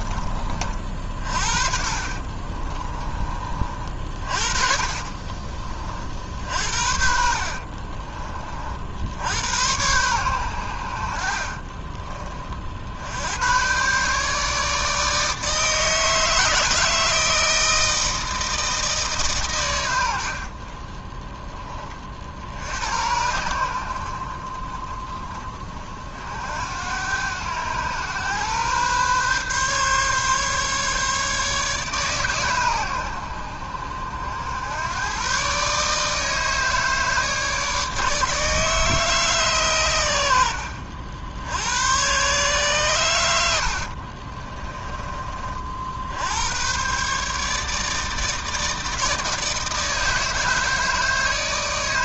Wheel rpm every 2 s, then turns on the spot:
40, 30, 40, 60, 70, 60, 80, 150, 160, 150, 20, 80, 40, 90, 130, 140, 100, 120, 150, 150, 70, 120, 30, 140, 160, 160.
0-2 4-8